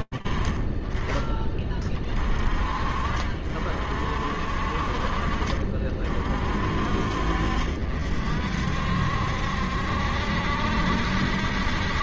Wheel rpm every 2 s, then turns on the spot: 30, 50, 40, 50, 70, 60.
none